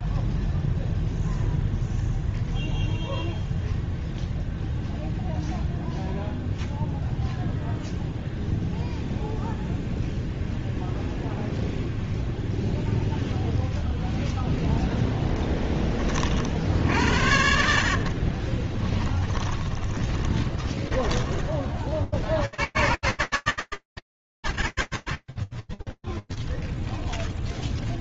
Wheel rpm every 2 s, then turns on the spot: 0, 0, 0, 0, 0, 0, 0, 0, 50, 30, 10, 90, 130, 0.
18-20